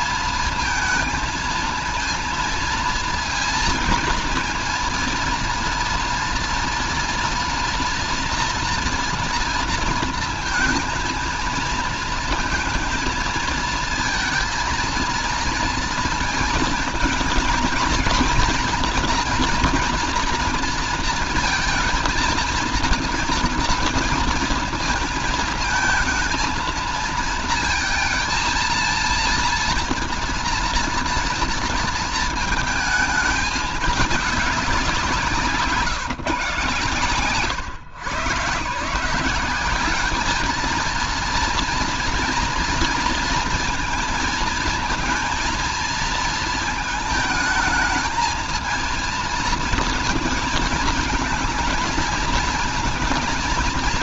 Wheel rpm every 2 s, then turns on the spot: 230, 230, 230, 230, 230, 230, 220, 230, 220, 230, 230, 230, 230, 220, 230, 230, 220, 200, 140, 140, 220, 230, 230, 220, 220, 220, 220.
none